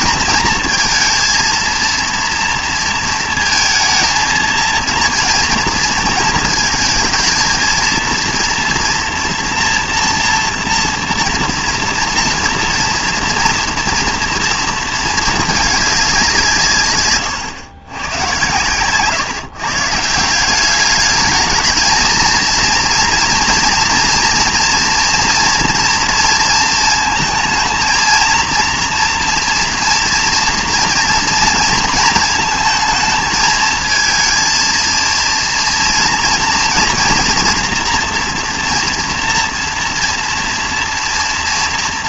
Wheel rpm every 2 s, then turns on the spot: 230, 230, 230, 220, 230, 230, 230, 230, 170, 120, 200, 230, 230, 230, 230, 230, 220, 230, 240, 240, 230.
none